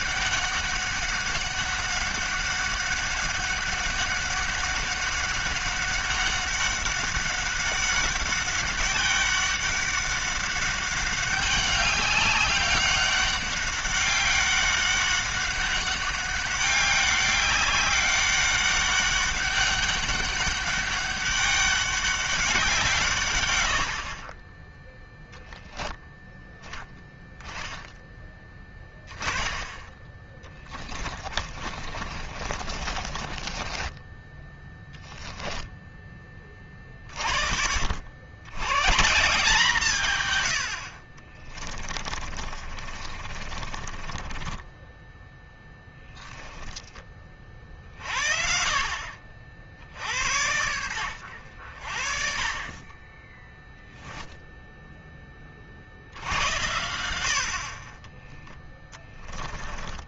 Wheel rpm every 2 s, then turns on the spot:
200, 200, 190, 200, 190, 200, 200, 200, 200, 200, 200, 190, 20, 10, 10, 20, 30, 10, 20, 110, 110, 50, 20, 10, 50, 80, 40, 0, 70, 10.
30-34 42-46